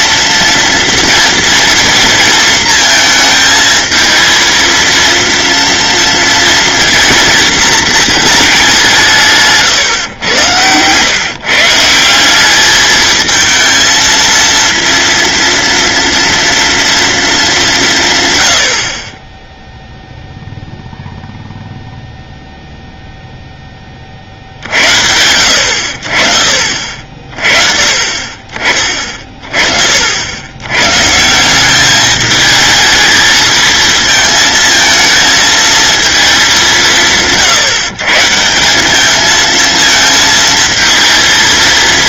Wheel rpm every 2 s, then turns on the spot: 230, 230, 230, 230, 180, 110, 210, 230, 230, 80, 0, 0, 70, 50, 30, 120, 220, 220, 180, 200, 230.
none